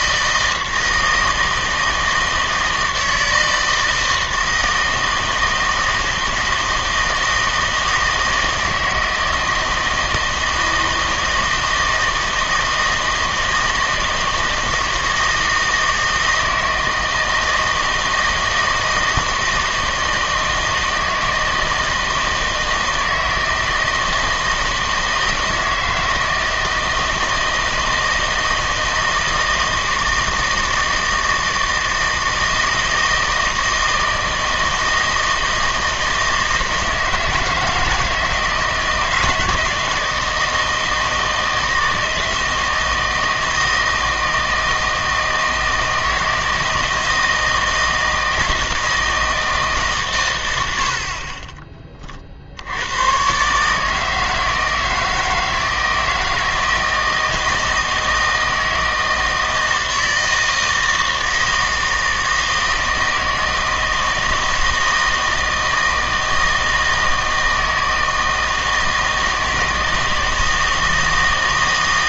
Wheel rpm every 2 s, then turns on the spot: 160, 160, 160, 160, 160, 160, 160, 160, 160, 160, 160, 160, 160, 160, 160, 160, 160, 160, 160, 160, 160, 160, 160, 160, 160, 80, 80, 160, 160, 160, 160, 160, 160, 160, 160, 160.
none